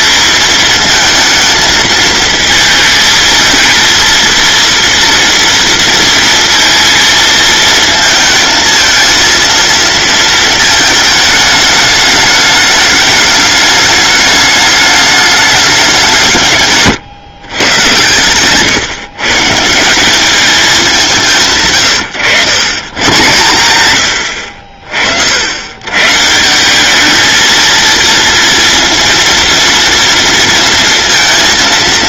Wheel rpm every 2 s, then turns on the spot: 220, 220, 230, 230, 230, 220, 210, 210, 130, 130, 190, 130, 50, 200, 230, 230.
16-18